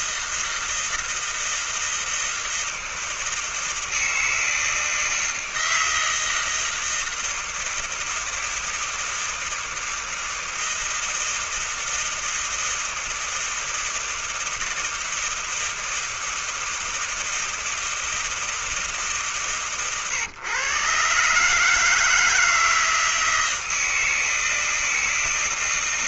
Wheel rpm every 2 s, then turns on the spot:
160, 160, 160, 160, 160, 160, 160, 160, 160, 160, 130, 150, 160.
none